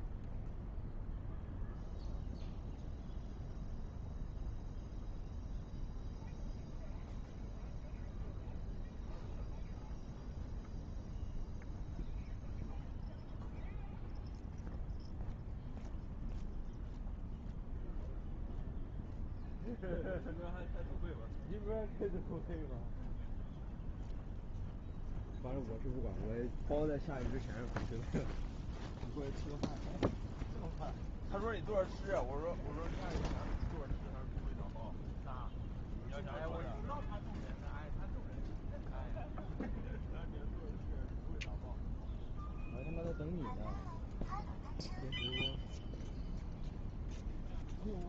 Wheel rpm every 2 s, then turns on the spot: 0, 0, 0, 0, 0, 0, 0, 0, 0, 0, 0, 0, 0, 0, 0, 0, 0, 0, 0, 0, 0, 0, 0, 0.
none